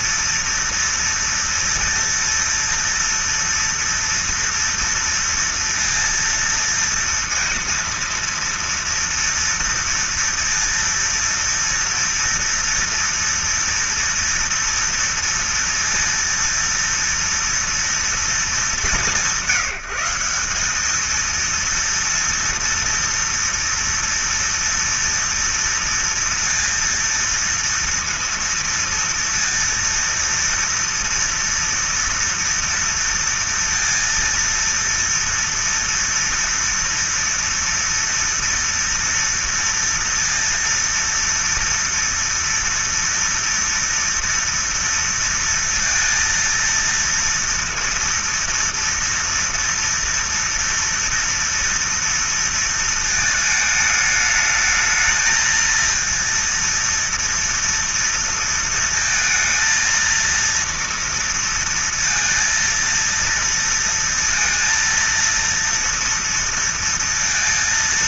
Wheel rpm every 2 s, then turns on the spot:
240, 230, 230, 230, 230, 230, 240, 230, 230, 220, 180, 230, 240, 230, 230, 230, 230, 230, 230, 230, 230, 230, 230, 230, 230, 230, 230, 210, 230, 230, 230, 230, 230, 230.
none